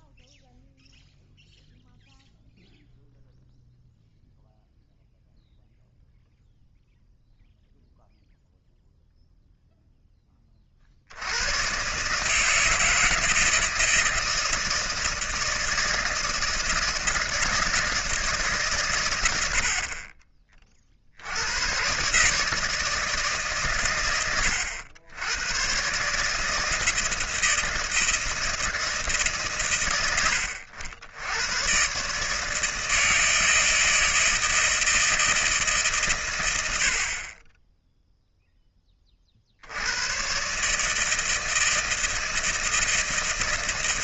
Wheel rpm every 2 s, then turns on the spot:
0, 0, 0, 0, 0, 30, 160, 160, 160, 130, 30, 160, 100, 160, 160, 90, 160, 160, 80, 10, 140, 160.
none